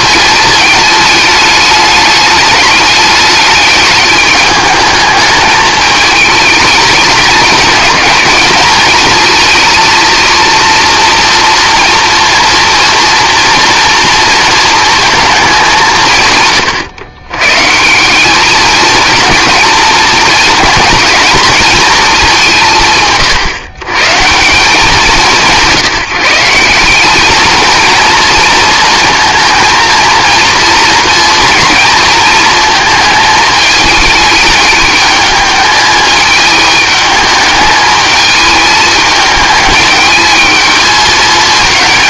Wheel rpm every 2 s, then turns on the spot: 210, 210, 210, 210, 210, 230, 230, 230, 120, 230, 230, 160, 180, 190, 220, 230, 230, 210, 210, 220, 220.
none